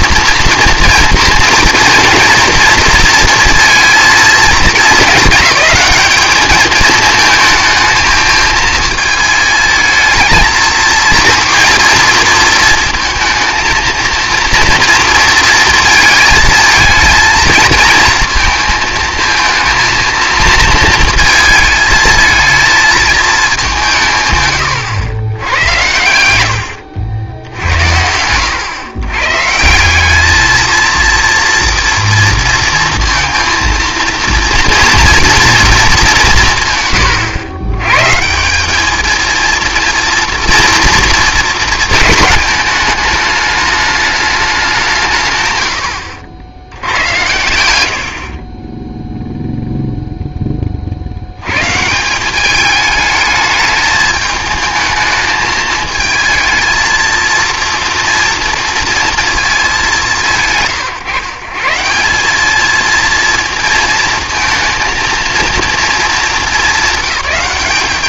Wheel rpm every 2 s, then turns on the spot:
240, 230, 220, 220, 220, 230, 230, 230, 220, 230, 230, 220, 110, 90, 100, 230, 230, 230, 140, 200, 240, 210, 180, 100, 20, 40, 210, 220, 220, 230, 130, 220, 230, 200.
none